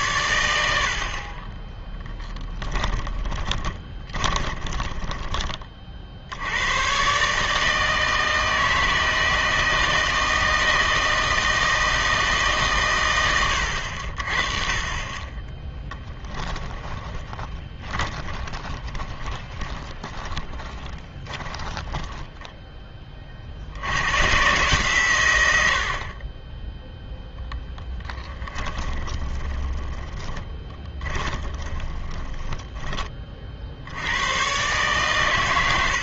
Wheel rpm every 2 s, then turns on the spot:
90, 10, 20, 90, 160, 160, 150, 30, 10, 20, 20, 10, 140, 10, 20, 20, 10, 120.
2-6 16-22 28-34